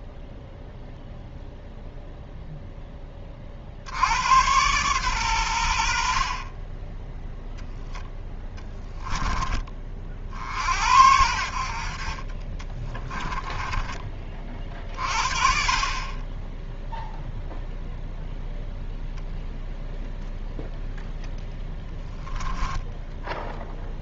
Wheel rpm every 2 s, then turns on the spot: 0, 0, 120, 20, 10, 70, 20, 40, 0, 0, 0, 10.
8-10 12-14 22-24